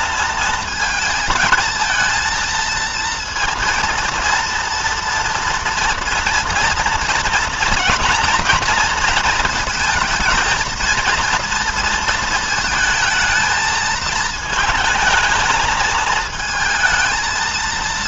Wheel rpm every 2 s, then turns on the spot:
230, 230, 230, 240, 230, 230, 230, 220, 220.
none